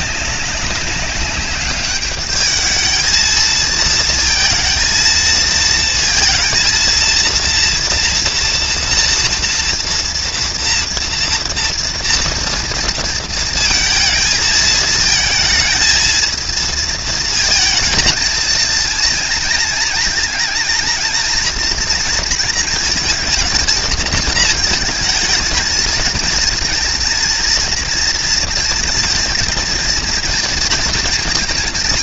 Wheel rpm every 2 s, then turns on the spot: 190, 210, 230, 230, 240, 230, 230, 220, 230, 220, 230, 230, 220, 230, 230, 230.
none